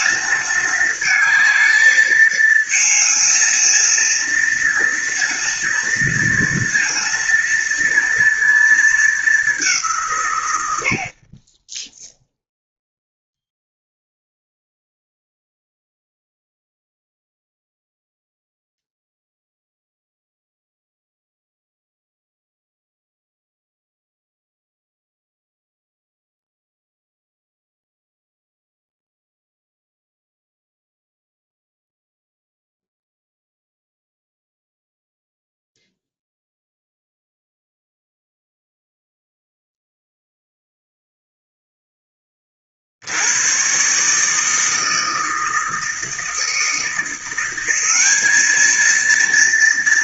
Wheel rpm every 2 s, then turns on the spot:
220, 220, 230, 230, 230, 130, 0, 0, 0, 0, 0, 0, 0, 0, 0, 0, 0, 0, 0, 0, 0, 20, 150, 160, 210.
none